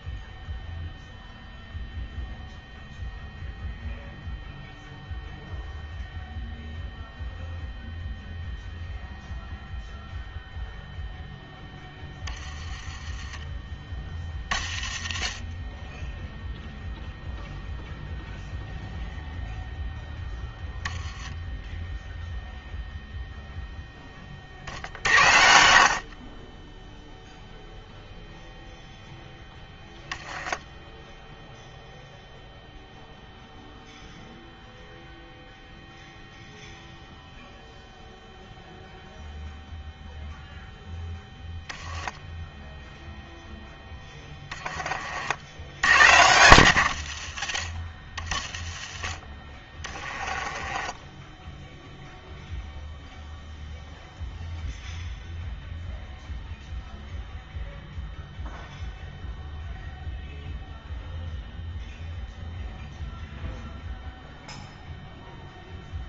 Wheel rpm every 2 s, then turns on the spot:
0, 0, 0, 0, 0, 0, 20, 40, 0, 0, 10, 0, 70, 10, 0, 10, 0, 0, 0, 0, 0, 0, 30, 120, 40, 20, 0, 0, 0, 0, 0, 0, 0.
44-46 50-52